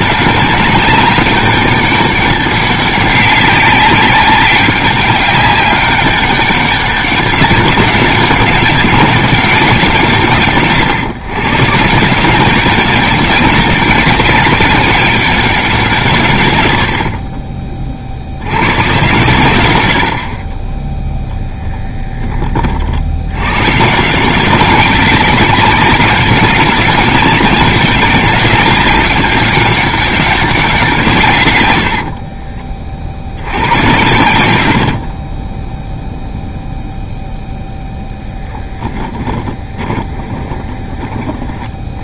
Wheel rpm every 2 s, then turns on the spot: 190, 200, 200, 200, 200, 130, 200, 200, 70, 130, 20, 50, 190, 200, 200, 180, 30, 80, 0, 10, 20.
34-36 38-42